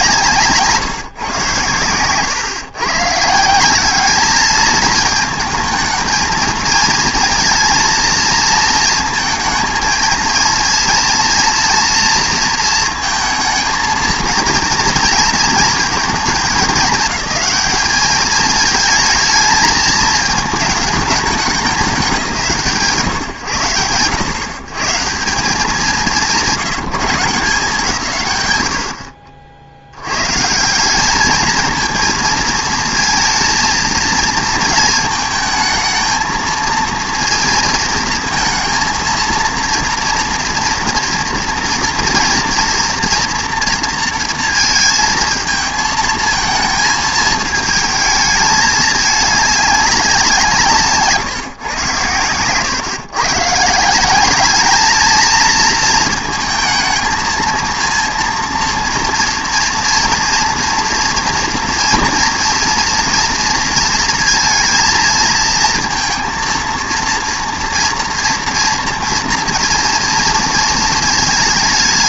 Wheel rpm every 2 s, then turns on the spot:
160, 130, 210, 230, 230, 230, 230, 230, 200, 220, 210, 130, 130, 170, 100, 170, 220, 220, 230, 230, 240, 230, 230, 220, 210, 150, 130, 210, 220, 230, 230, 230, 230, 230, 230, 220.
none